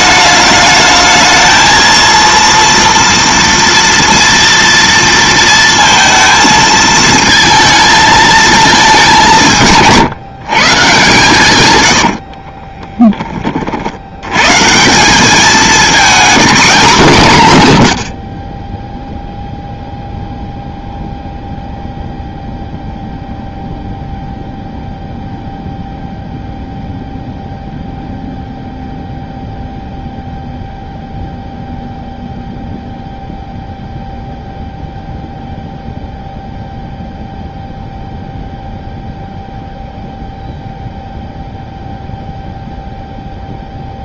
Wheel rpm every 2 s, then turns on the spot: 210, 230, 230, 220, 210, 140, 20, 170, 210, 10, 0, 0, 0, 0, 0, 0, 0, 0, 0, 0, 0, 0.
12-14